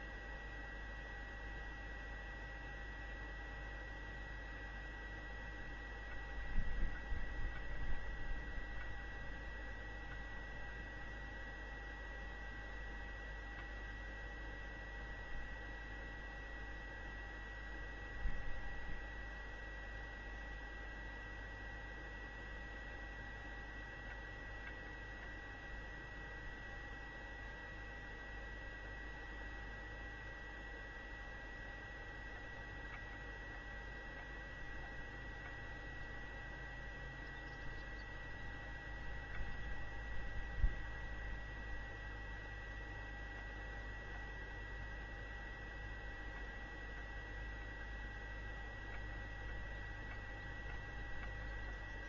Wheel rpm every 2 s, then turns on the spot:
0, 0, 0, 0, 0, 0, 0, 0, 0, 0, 0, 0, 0, 0, 0, 0, 0, 0, 0, 0, 0, 0, 0, 0, 0, 0.
none